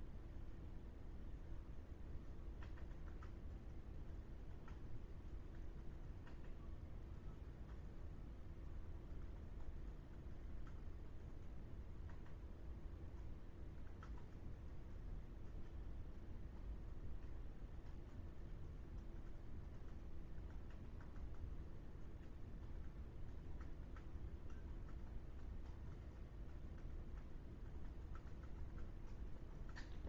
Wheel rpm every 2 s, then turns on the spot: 0, 0, 0, 0, 0, 0, 0, 0, 0, 0, 0, 0, 0, 0, 0.
none